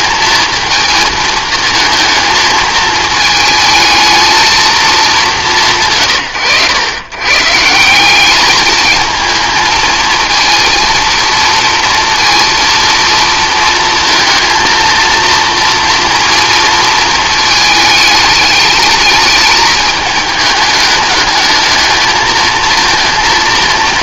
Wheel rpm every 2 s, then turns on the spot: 220, 220, 210, 110, 210, 230, 230, 230, 230, 210, 210, 230.
none